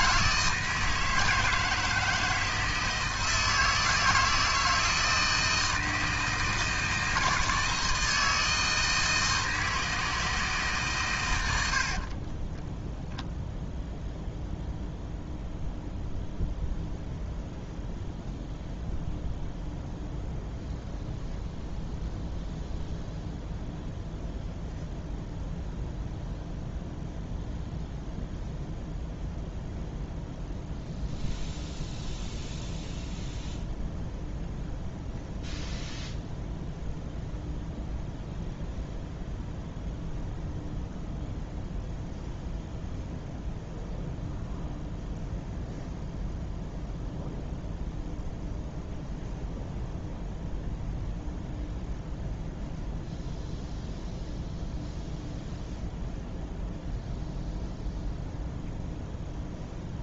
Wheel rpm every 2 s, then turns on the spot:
160, 160, 160, 160, 160, 150, 10, 0, 0, 0, 0, 0, 0, 0, 0, 0, 0, 0, 0, 0, 0, 0, 0, 0, 0, 0, 0, 0, 0, 0.
none